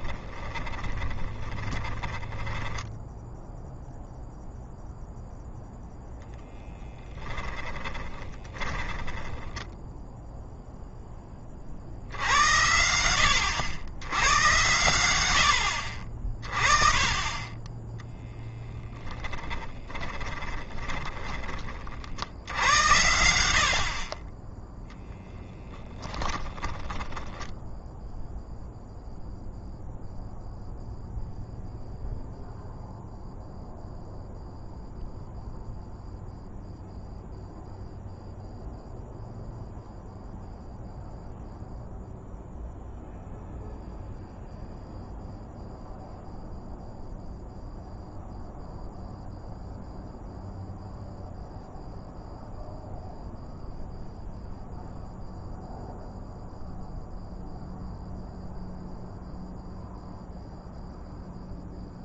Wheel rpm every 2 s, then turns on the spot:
10, 10, 0, 10, 10, 10, 90, 110, 20, 0, 20, 80, 10, 20, 0, 0, 0, 0, 0, 0, 0, 0, 0, 0, 0, 0, 0, 0, 0, 0, 0.
0-4 6-10 20-22 26-28